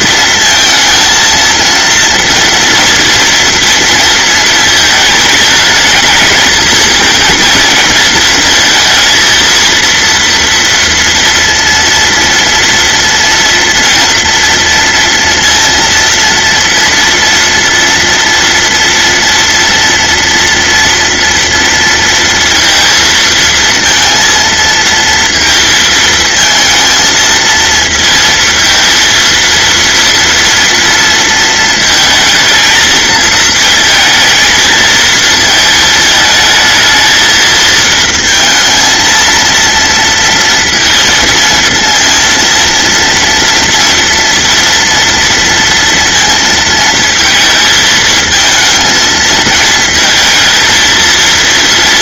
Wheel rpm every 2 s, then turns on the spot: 230, 230, 230, 220, 230, 230, 230, 230, 230, 230, 230, 230, 230, 230, 220, 230, 230, 220, 230, 220, 230, 230, 230, 230, 220, 220.
none